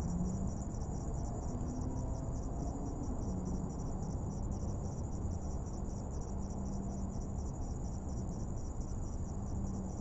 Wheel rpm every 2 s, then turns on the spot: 0, 0, 0, 0, 0.
none